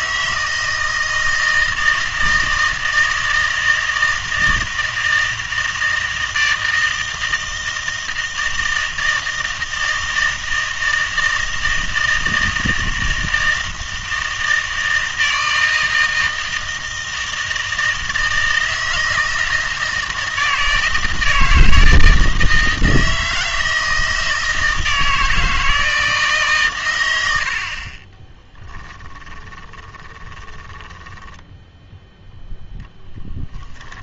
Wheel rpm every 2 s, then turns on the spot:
160, 160, 160, 160, 160, 160, 160, 160, 160, 160, 160, 160, 160, 120, 10, 10, 0.
28-32